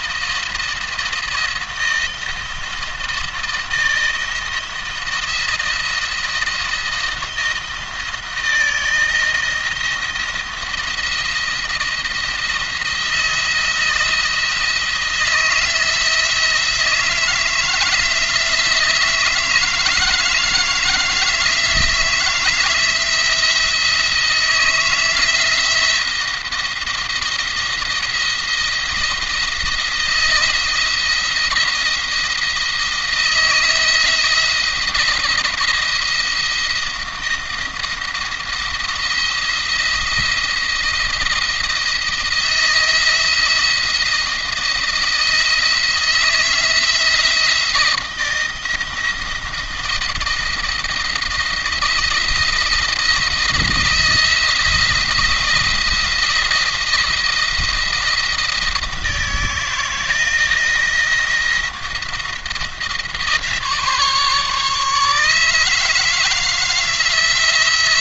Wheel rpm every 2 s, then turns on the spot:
170, 160, 170, 170, 160, 170, 170, 160, 160, 160, 160, 160, 160, 170, 170, 160, 170, 170, 170, 170, 170, 170, 170, 160, 160, 170, 160, 170, 170, 160, 170, 160, 150, 160.
none